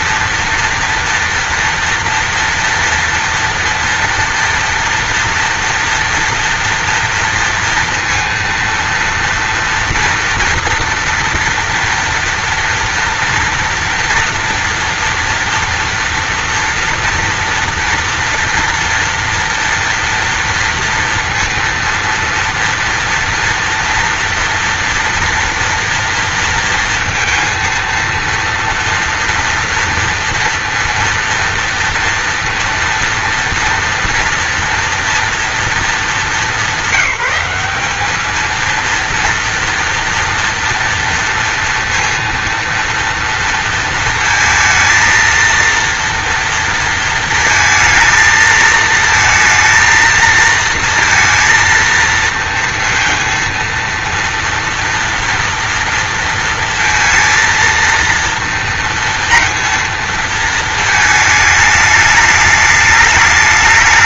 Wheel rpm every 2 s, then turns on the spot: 230, 230, 230, 230, 230, 240, 230, 230, 230, 230, 240, 230, 230, 230, 230, 230, 230, 230, 190, 230, 230, 230, 230, 230, 230, 230, 230, 230, 230, 230, 220, 210.
none